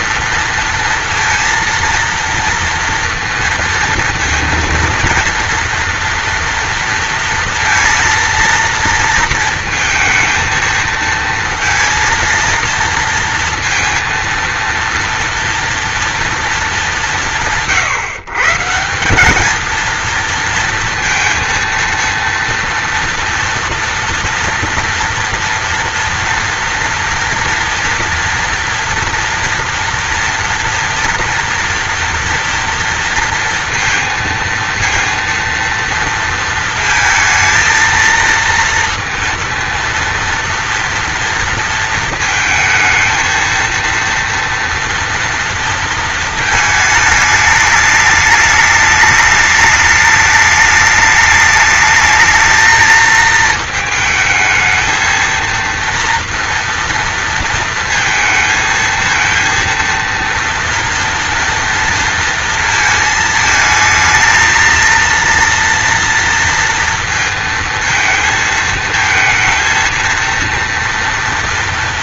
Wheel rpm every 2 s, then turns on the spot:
230, 240, 230, 230, 230, 230, 230, 230, 160, 180, 230, 240, 230, 230, 230, 230, 230, 230, 220, 230, 230, 230, 230, 220, 210, 210, 220, 220, 230, 230, 230, 230, 230, 230, 220, 230.
none